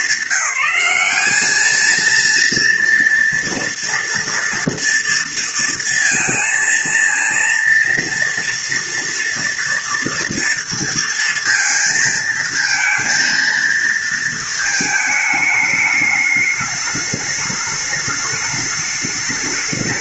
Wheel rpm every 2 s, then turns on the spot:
200, 230, 230, 230, 240, 230, 230, 220, 210, 210.
none